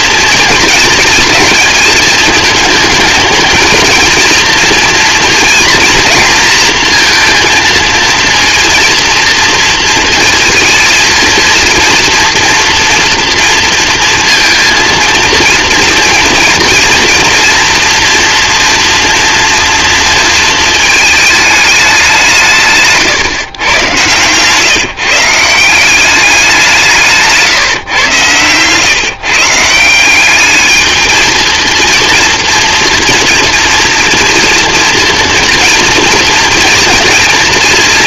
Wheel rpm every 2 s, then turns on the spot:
230, 220, 230, 230, 230, 230, 230, 230, 230, 230, 220, 150, 150, 170, 130, 210, 240, 230, 230.
none